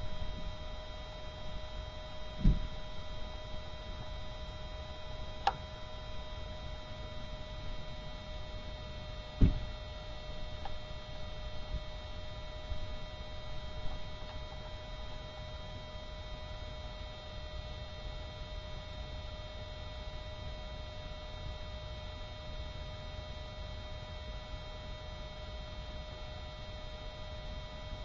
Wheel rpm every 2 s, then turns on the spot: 0, 0, 0, 0, 0, 0, 0, 0, 0, 0, 0, 0, 0, 0.
none